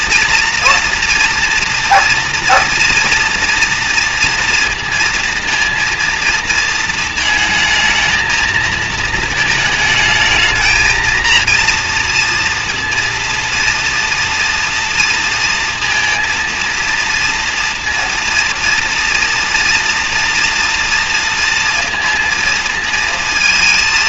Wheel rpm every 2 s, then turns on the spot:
230, 230, 230, 230, 220, 220, 230, 230, 230, 230, 230, 230.
none